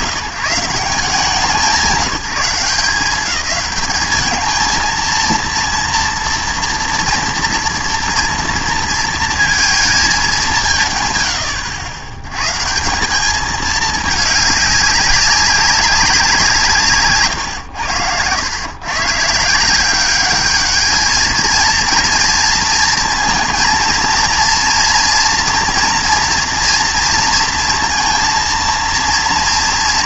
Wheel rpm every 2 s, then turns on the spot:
160, 190, 220, 230, 230, 170, 120, 200, 170, 110, 210, 230, 230, 230, 230.
none